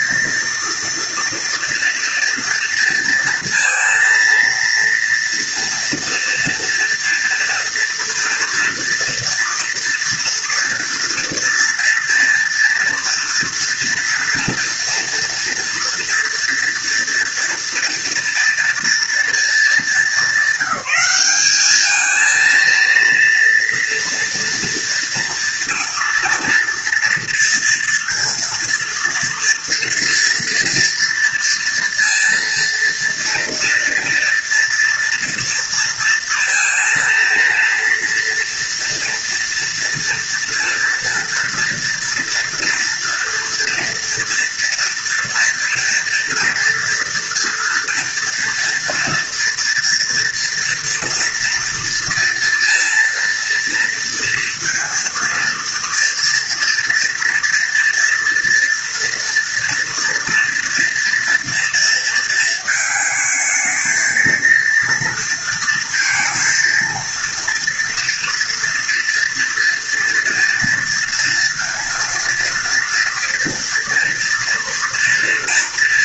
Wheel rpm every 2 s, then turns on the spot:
230, 230, 230, 230, 230, 230, 240, 230, 230, 240, 210, 230, 230, 230, 230, 230, 230, 240, 230, 230, 230, 230, 230, 230, 230, 230, 230, 230, 230, 230, 230, 220, 230, 230, 230, 230, 230, 230.
none